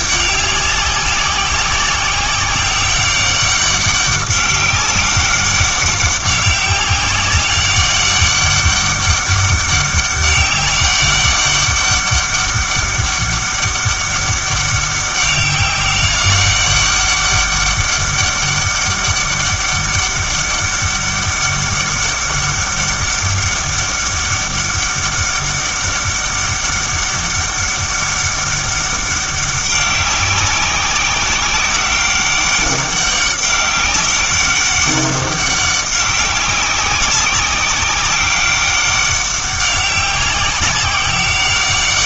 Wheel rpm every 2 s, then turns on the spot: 190, 190, 200, 200, 200, 200, 200, 200, 200, 200, 200, 200, 200, 200, 200, 190, 200, 190, 190, 200, 190.
none